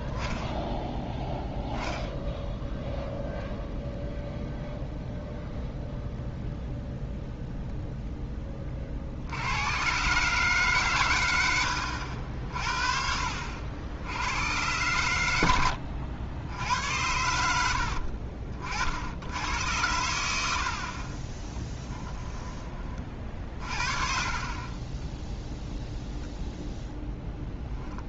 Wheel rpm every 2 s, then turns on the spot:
10, 0, 0, 0, 30, 140, 50, 100, 80, 50, 60, 20, 30, 0.
none